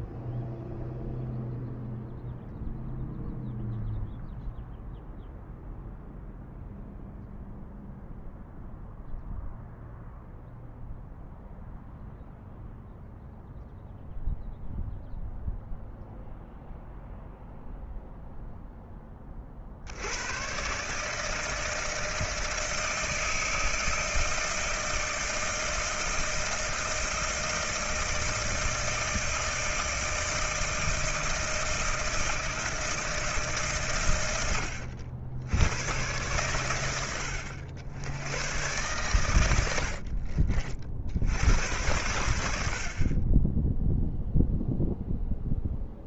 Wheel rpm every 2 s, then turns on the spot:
0, 0, 0, 0, 0, 0, 0, 0, 0, 10, 130, 160, 160, 160, 160, 160, 160, 90, 100, 120, 60, 60, 0.
none